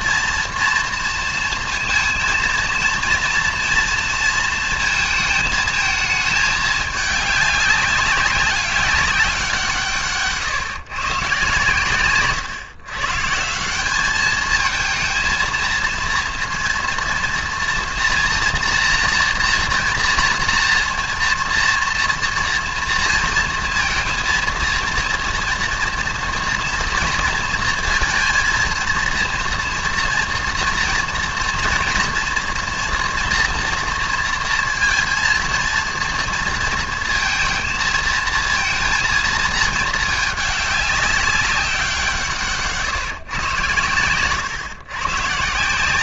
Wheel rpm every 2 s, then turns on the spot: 230, 230, 230, 220, 190, 140, 130, 220, 230, 240, 230, 230, 230, 230, 220, 230, 230, 230, 230, 230, 200, 150, 120.
none